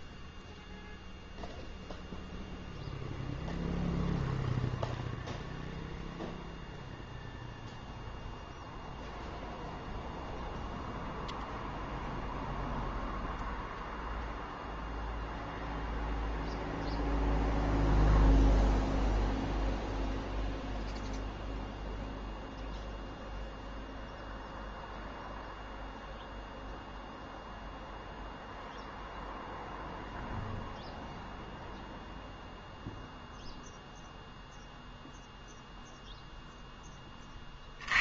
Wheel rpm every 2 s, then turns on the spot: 0, 0, 0, 0, 0, 0, 0, 0, 0, 0, 0, 0, 0, 0, 0, 0, 0, 0, 20.
none